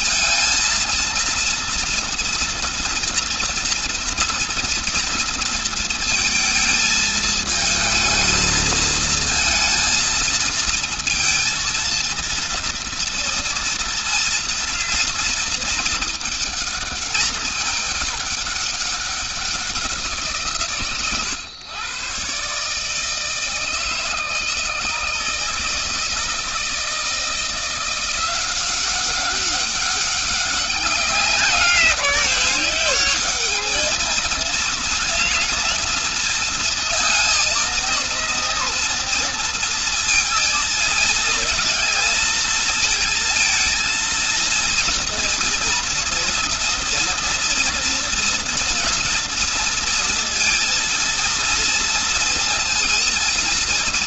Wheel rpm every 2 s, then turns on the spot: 230, 230, 230, 220, 230, 230, 230, 230, 210, 180, 130, 160, 160, 170, 200, 200, 220, 230, 230, 230, 230, 230, 230, 230, 230, 230, 240.
none